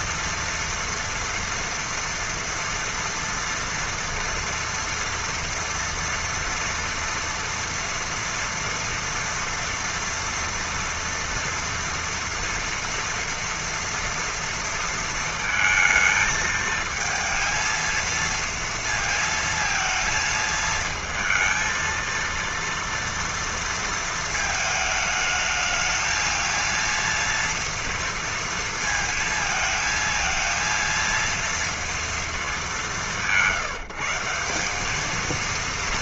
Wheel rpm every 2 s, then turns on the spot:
230, 240, 230, 230, 240, 230, 230, 230, 220, 230, 220, 230, 220, 230, 230, 230, 220, 180.
none